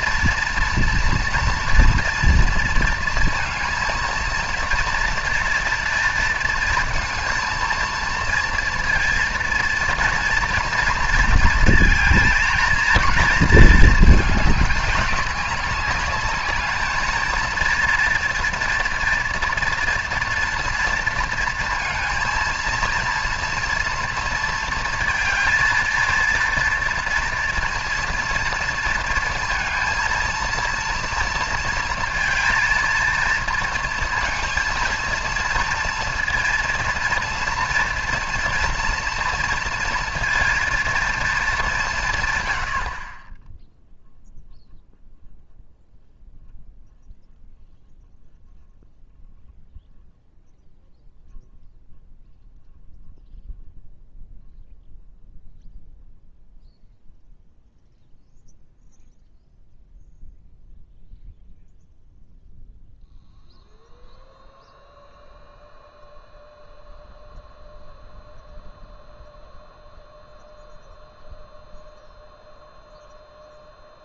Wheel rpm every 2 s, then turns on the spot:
230, 230, 230, 230, 230, 230, 230, 210, 210, 230, 230, 230, 230, 230, 230, 230, 230, 230, 230, 230, 230, 100, 0, 0, 0, 0, 0, 0, 0, 0, 0, 0, 0, 0, 0, 0, 0.
none